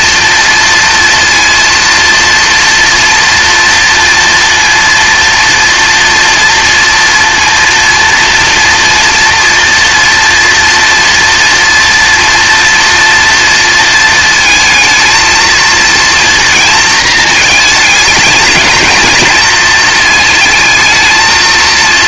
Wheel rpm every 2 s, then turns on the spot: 240, 230, 230, 230, 230, 240, 230, 220, 230, 220, 220.
none